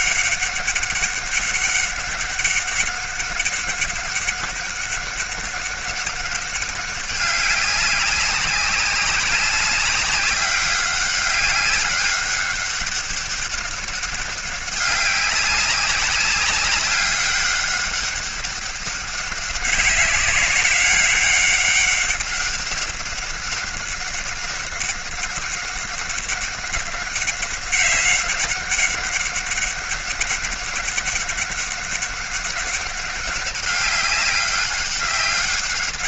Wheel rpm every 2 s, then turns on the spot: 200, 200, 200, 200, 200, 200, 200, 190, 200, 200, 200, 190, 200, 200, 200, 200, 200, 200.
none